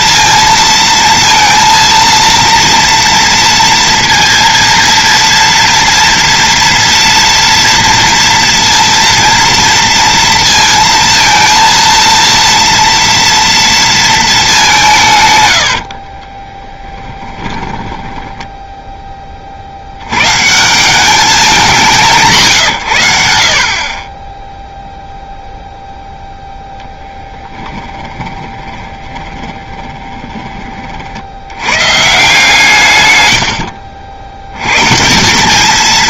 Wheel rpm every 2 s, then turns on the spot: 230, 230, 230, 230, 230, 230, 230, 180, 20, 10, 160, 120, 0, 0, 20, 30, 150, 100.
16-20 28-30